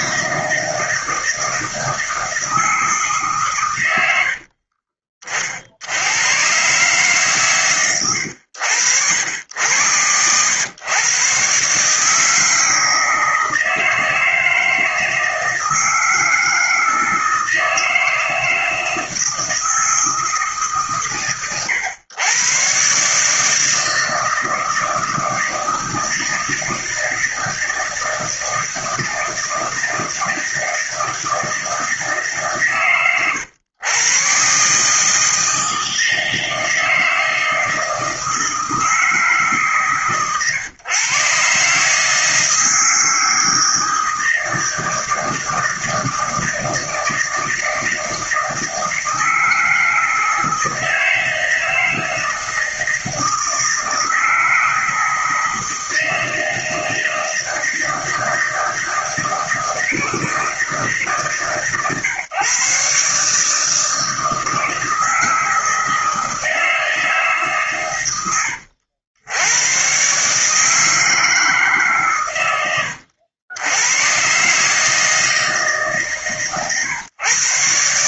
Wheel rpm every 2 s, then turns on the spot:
160, 140, 30, 130, 90, 130, 160, 160, 160, 160, 120, 150, 160, 160, 160, 160, 130, 160, 160, 150, 130, 160, 160, 160, 160, 160, 160, 160, 160, 160, 150, 150, 160, 150, 90, 150, 80, 160, 130.
none